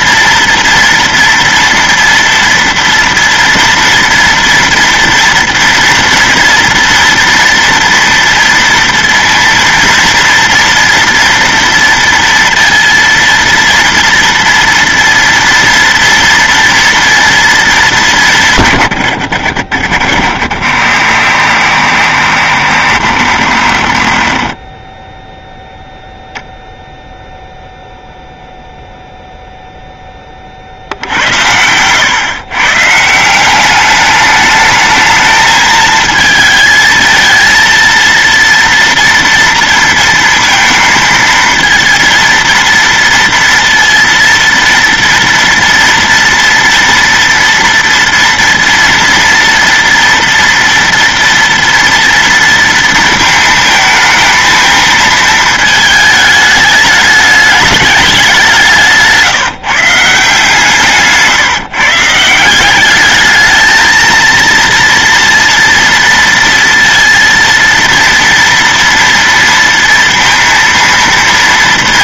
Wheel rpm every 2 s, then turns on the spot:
230, 230, 230, 230, 230, 230, 230, 230, 230, 170, 80, 70, 30, 0, 0, 10, 130, 210, 220, 230, 230, 230, 230, 230, 230, 230, 230, 220, 210, 200, 160, 160, 230, 230, 230, 230.
none